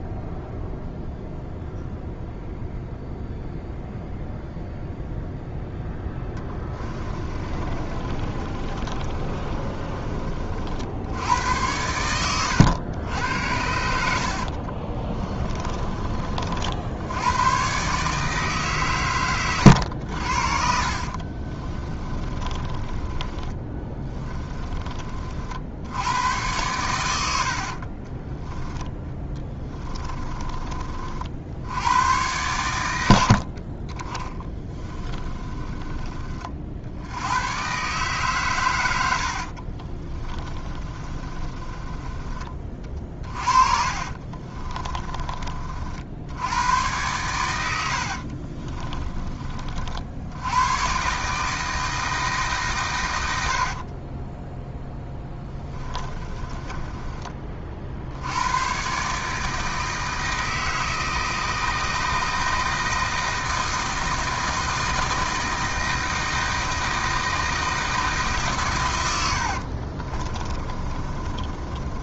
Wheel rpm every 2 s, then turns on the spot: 0, 0, 0, 20, 30, 60, 100, 40, 70, 130, 40, 20, 30, 110, 10, 40, 100, 20, 70, 90, 30, 30, 30, 110, 30, 120, 120, 10, 20, 130, 160, 160, 160, 160, 120, 30.
6-10 14-16 20-26 28-30 34-36 40-42 44-46 48-50 54-58 70-72